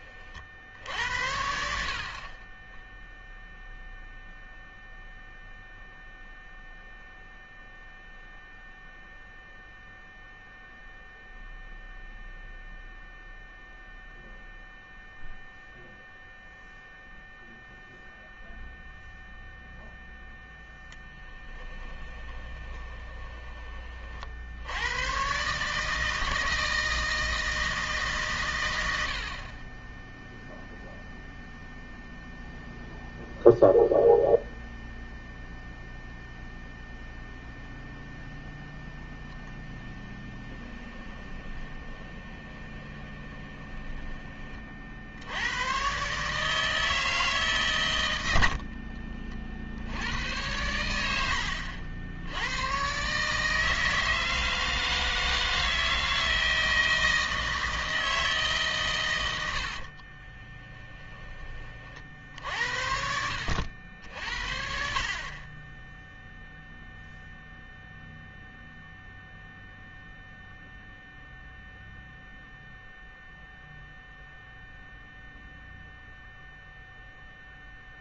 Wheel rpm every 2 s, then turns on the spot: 60, 10, 0, 0, 0, 0, 0, 0, 0, 0, 10, 20, 90, 160, 100, 0, 0, 0, 0, 10, 20, 20, 50, 160, 50, 100, 130, 160, 160, 130, 10, 70, 50, 0, 0, 0, 0, 0, 0.
20-24 40-44 48-50 60-62